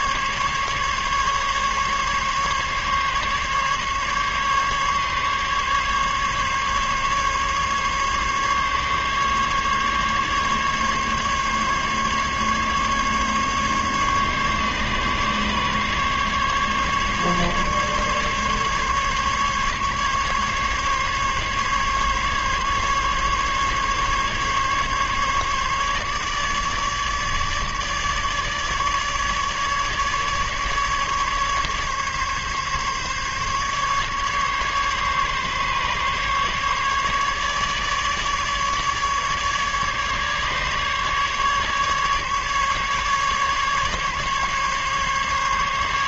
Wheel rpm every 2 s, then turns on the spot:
140, 140, 140, 140, 140, 140, 140, 140, 140, 140, 140, 140, 140, 150, 150, 150, 140, 140, 140, 150, 150, 150, 140.
none